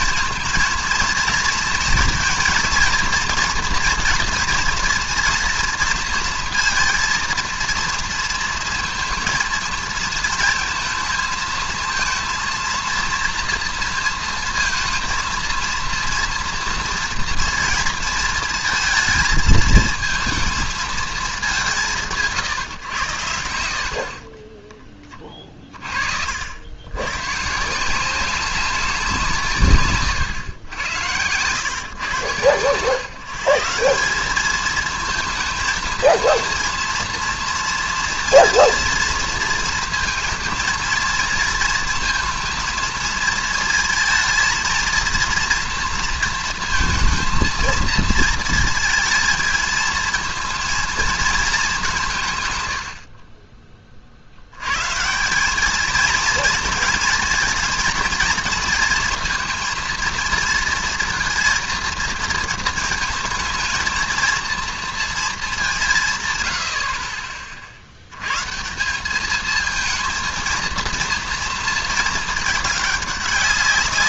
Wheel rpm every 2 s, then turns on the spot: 230, 230, 230, 230, 230, 230, 230, 230, 230, 220, 220, 130, 20, 110, 190, 110, 130, 220, 230, 230, 230, 220, 230, 230, 220, 230, 110, 110, 230, 230, 230, 220, 230, 80, 180, 230, 210.
none